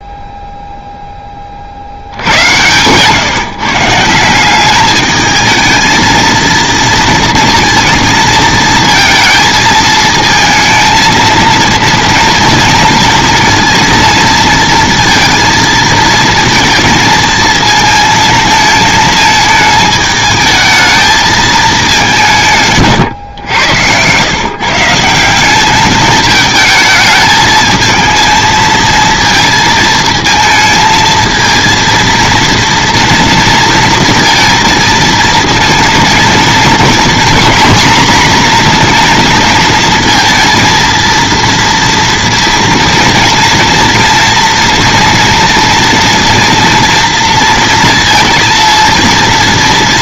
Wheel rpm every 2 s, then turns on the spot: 0, 100, 180, 230, 220, 220, 230, 230, 230, 220, 220, 170, 140, 220, 230, 220, 230, 230, 220, 240, 230, 230, 230, 230, 230.
none